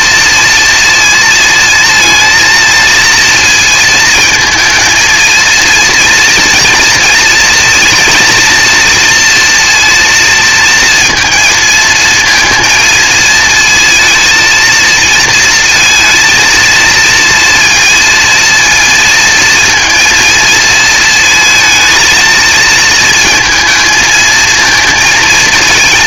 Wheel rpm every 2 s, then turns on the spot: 230, 230, 230, 230, 230, 230, 230, 230, 230, 230, 230, 220, 230.
none